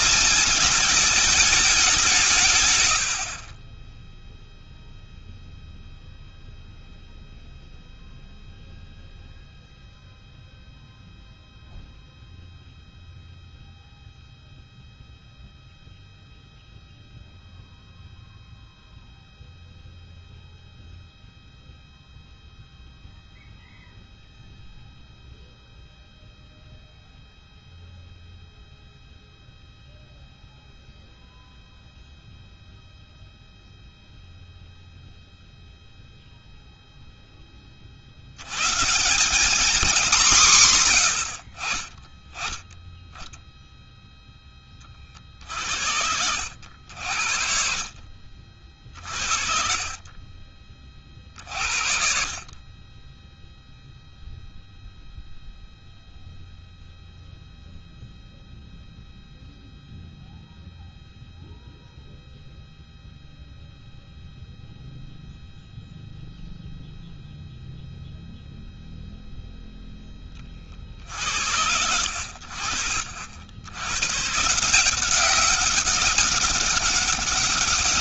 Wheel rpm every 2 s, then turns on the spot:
220, 120, 0, 0, 0, 0, 0, 0, 0, 0, 0, 0, 0, 0, 0, 0, 0, 0, 0, 120, 160, 10, 20, 70, 50, 40, 30, 0, 0, 0, 0, 0, 0, 0, 0, 40, 60, 160, 200.
2-4 48-50